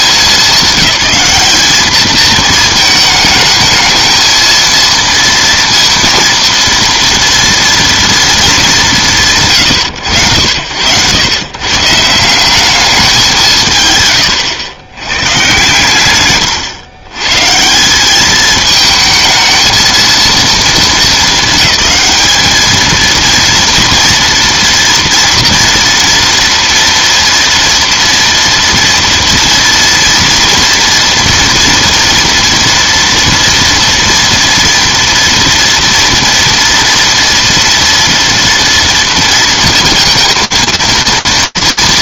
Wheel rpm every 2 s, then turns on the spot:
200, 220, 230, 230, 220, 100, 200, 120, 110, 220, 220, 210, 230, 230, 230, 230, 230, 230, 230, 230, 230.
none